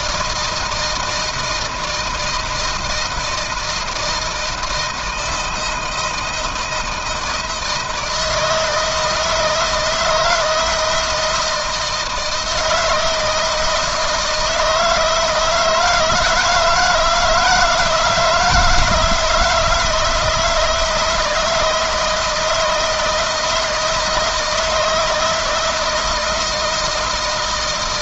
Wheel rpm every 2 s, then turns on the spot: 160, 160, 160, 160, 160, 170, 160, 160, 160, 160, 160, 160, 160, 160.
none